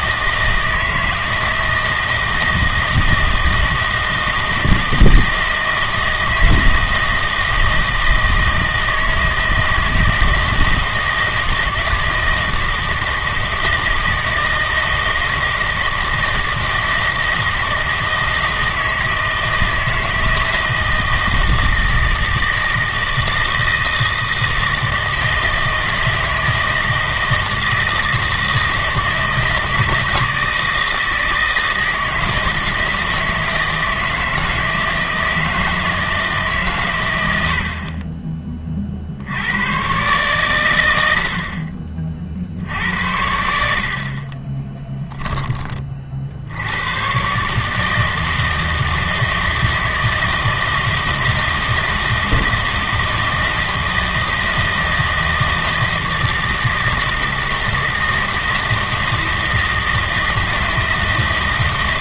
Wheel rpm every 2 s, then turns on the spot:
160, 160, 160, 160, 160, 160, 160, 160, 160, 160, 160, 160, 160, 160, 160, 160, 160, 160, 130, 40, 100, 80, 20, 100, 160, 160, 160, 160, 160, 160, 160.
44-46